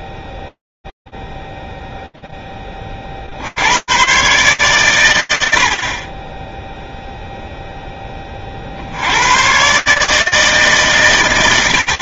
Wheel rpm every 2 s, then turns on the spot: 0, 0, 130, 20, 50, 160.
none